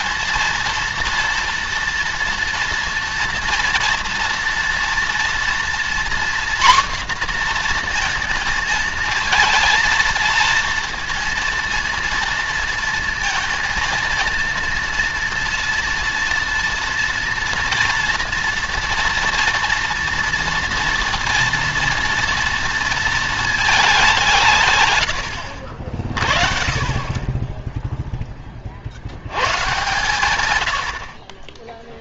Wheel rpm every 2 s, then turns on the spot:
230, 240, 230, 250, 230, 230, 230, 230, 240, 230, 230, 230, 120, 30, 50, 80.
24-26